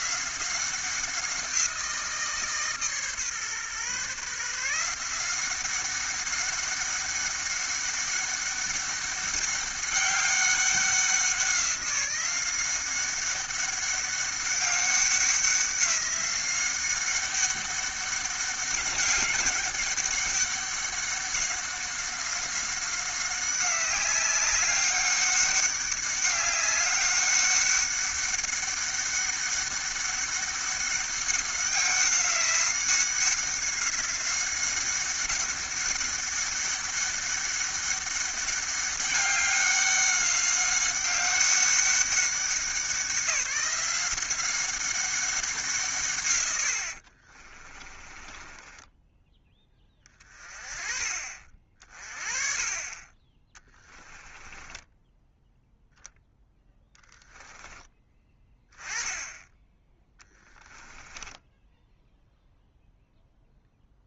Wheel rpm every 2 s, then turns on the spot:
190, 140, 170, 200, 200, 190, 190, 190, 190, 200, 190, 190, 190, 200, 200, 200, 190, 190, 200, 200, 190, 190, 190, 80, 10, 30, 30, 10, 10, 10, 10, 0.
46-50 54-58 60-62